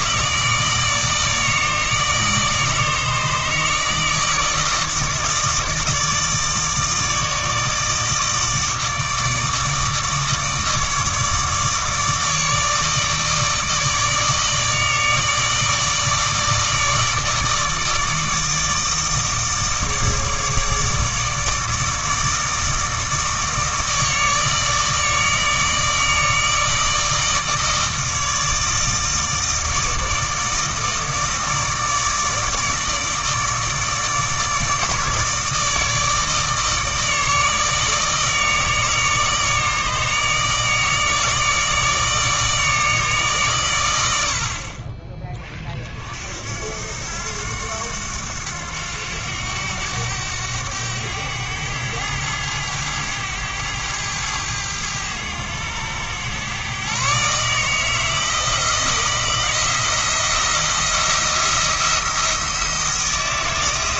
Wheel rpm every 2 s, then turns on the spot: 150, 150, 160, 160, 160, 150, 150, 150, 160, 160, 160, 160, 160, 160, 150, 160, 160, 150, 150, 150, 150, 160, 50, 60, 90, 100, 100, 100, 120, 170, 170, 170.
none